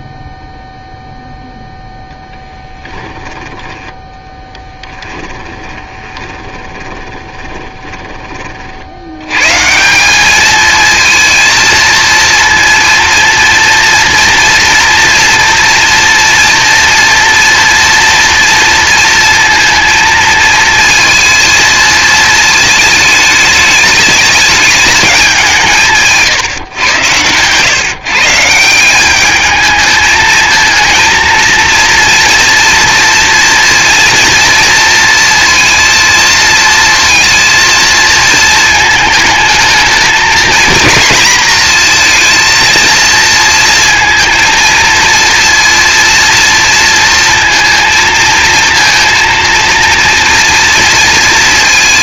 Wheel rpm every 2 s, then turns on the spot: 0, 10, 10, 20, 70, 230, 230, 230, 240, 230, 230, 220, 210, 120, 180, 220, 230, 230, 230, 220, 230, 230, 230, 230, 230, 230.
2-8